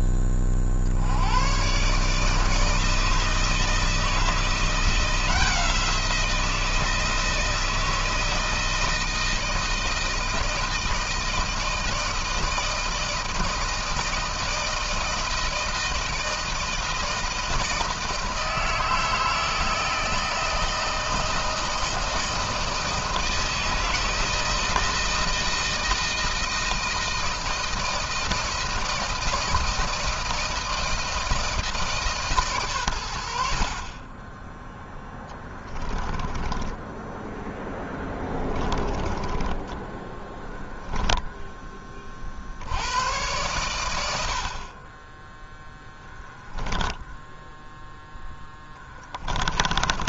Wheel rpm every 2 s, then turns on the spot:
60, 160, 170, 160, 160, 160, 160, 160, 160, 160, 160, 160, 160, 160, 160, 160, 120, 10, 10, 30, 10, 90, 30, 10, 10.
36-42 46-50